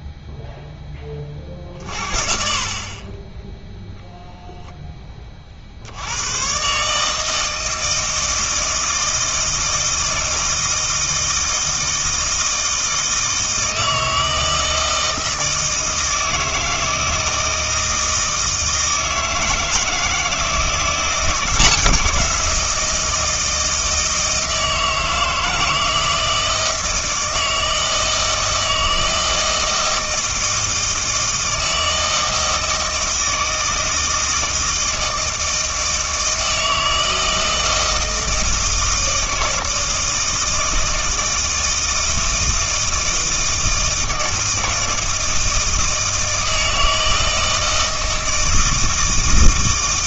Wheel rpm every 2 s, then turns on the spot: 10, 50, 10, 140, 160, 160, 160, 160, 160, 160, 170, 170, 160, 160, 160, 160, 160, 160, 160, 160, 160, 160, 160, 160, 160.
none